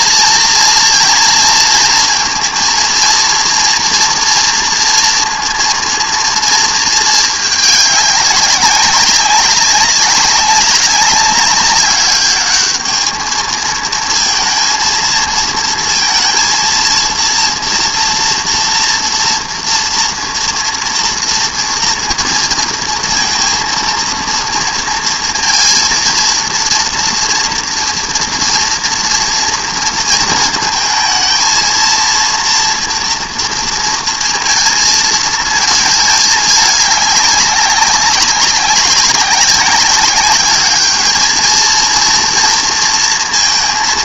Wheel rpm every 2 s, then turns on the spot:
230, 230, 240, 230, 200, 190, 210, 230, 230, 230, 230, 230, 230, 230, 240, 230, 230, 230, 210, 190, 210, 230.
none